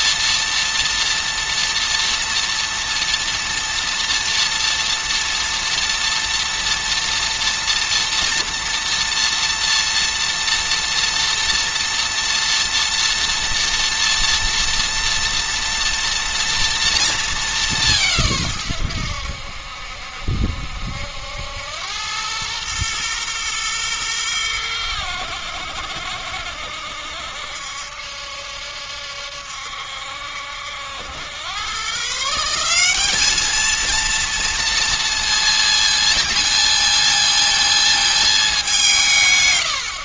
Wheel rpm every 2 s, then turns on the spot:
240, 230, 230, 230, 230, 230, 230, 230, 230, 90, 80, 120, 90, 70, 70, 90, 200, 230, 220, 140.
none